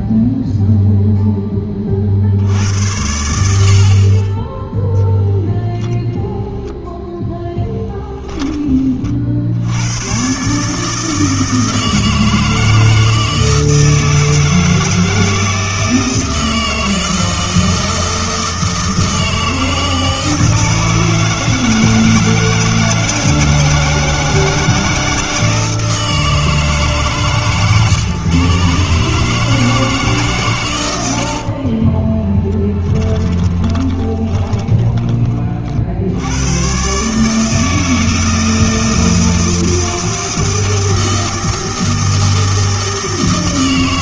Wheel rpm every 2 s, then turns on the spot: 0, 90, 10, 0, 30, 150, 160, 160, 160, 160, 160, 160, 160, 140, 140, 110, 10, 20, 120, 160, 160, 160.
32-36